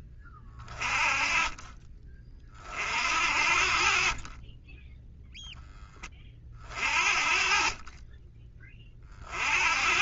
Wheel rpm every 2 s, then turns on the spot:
20, 50, 0, 40, 40.
none